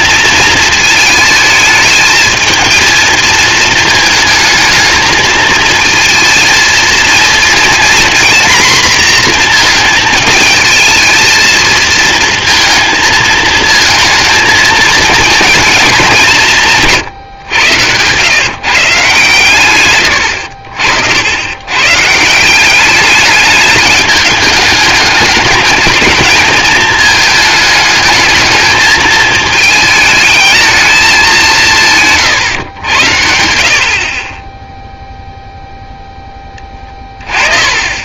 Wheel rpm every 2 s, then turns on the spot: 220, 220, 220, 230, 240, 220, 230, 220, 160, 150, 70, 190, 210, 220, 220, 220, 100, 0, 20.
36-38